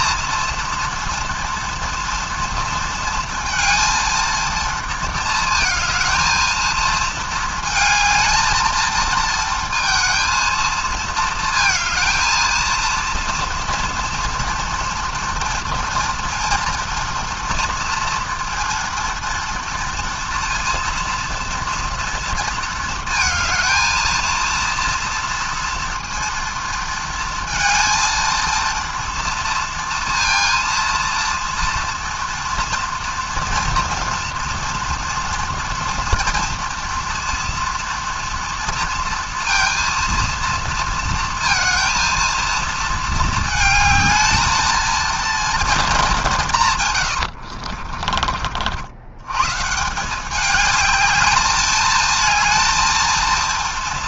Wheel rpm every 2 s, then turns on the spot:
230, 230, 220, 220, 220, 220, 230, 240, 230, 230, 230, 230, 230, 230, 230, 230, 230, 230, 230, 230, 230, 220, 220, 170, 50, 200, 230.
none